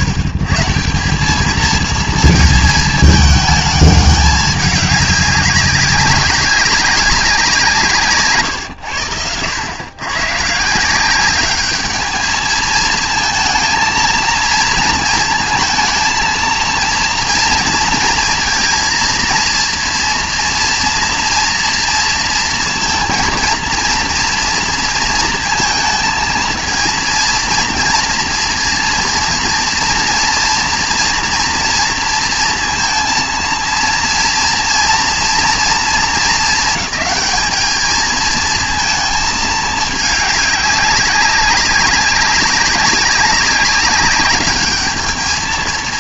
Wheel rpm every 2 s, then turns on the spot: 110, 220, 200, 200, 120, 140, 220, 230, 230, 230, 230, 230, 230, 220, 230, 230, 230, 230, 220, 220, 200, 200, 210.
none